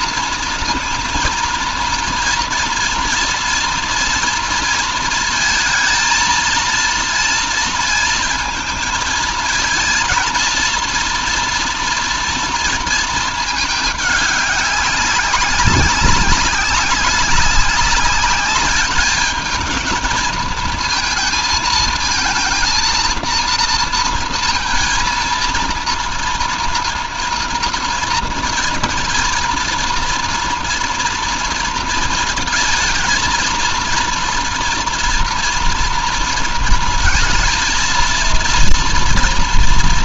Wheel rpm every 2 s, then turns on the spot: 230, 230, 230, 230, 230, 230, 230, 200, 200, 210, 220, 230, 230, 240, 230, 230, 230, 230, 230, 230.
none